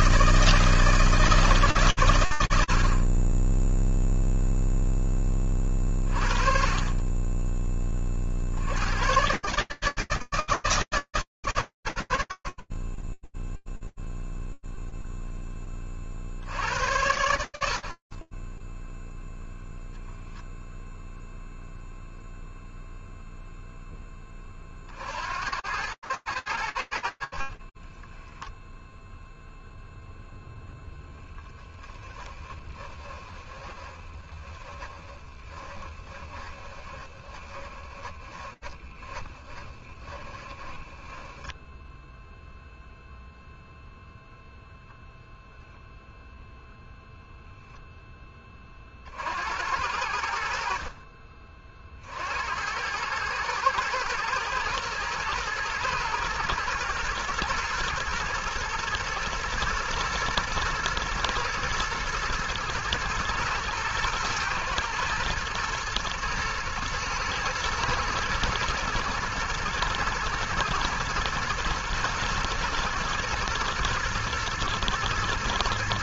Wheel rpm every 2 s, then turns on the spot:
150, 10, 20, 20, 140, 140, 20, 0, 90, 10, 0, 0, 80, 70, 0, 10, 20, 20, 20, 20, 0, 0, 0, 20, 60, 70, 110, 110, 120, 110, 110, 120, 120, 110, 110, 110, 110, 120.
32-40